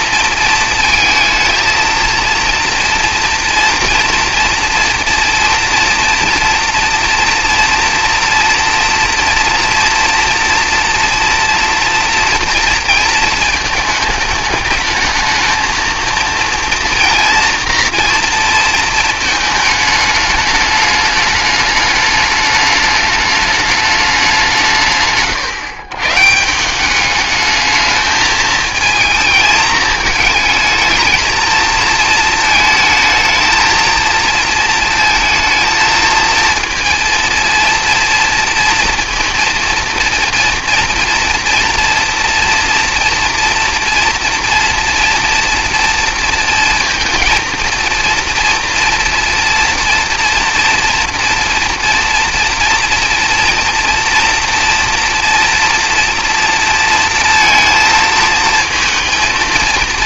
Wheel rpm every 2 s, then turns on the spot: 230, 230, 230, 230, 230, 230, 230, 210, 230, 220, 210, 210, 170, 190, 220, 220, 220, 230, 230, 230, 230, 230, 230, 230, 230, 230, 240, 230, 230, 230.
none